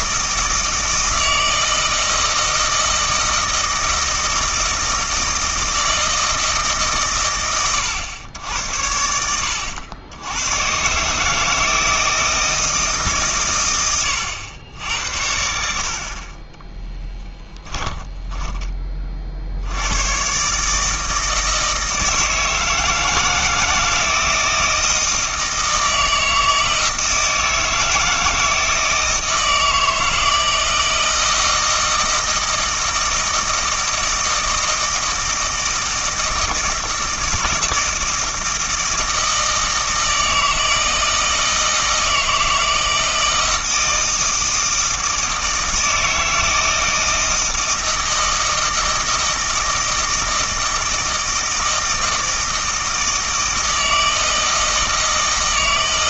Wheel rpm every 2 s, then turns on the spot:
160, 160, 160, 150, 80, 130, 160, 90, 10, 20, 150, 160, 160, 160, 160, 160, 160, 160, 160, 160, 160, 160, 160, 160, 160, 160, 160, 160.
16-18